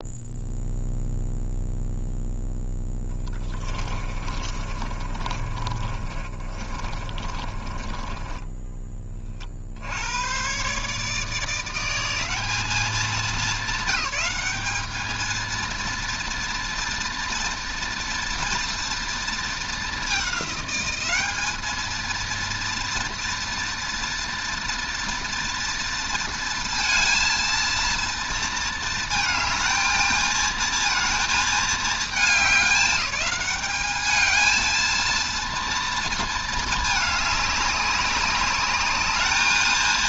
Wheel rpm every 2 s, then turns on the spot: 0, 0, 30, 30, 20, 130, 200, 210, 230, 230, 200, 230, 240, 230, 230, 220, 210, 230, 220, 200.
4-10